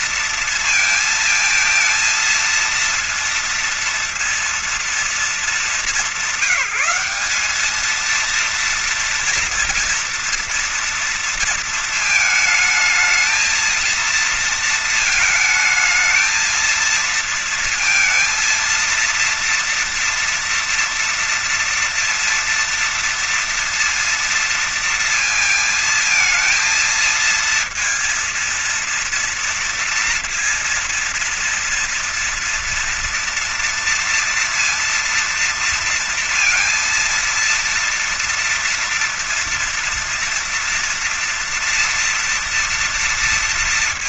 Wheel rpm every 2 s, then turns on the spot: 230, 230, 230, 200, 230, 230, 220, 230, 230, 230, 230, 230, 230, 220, 230, 230, 230, 230, 230, 230, 230, 240.
none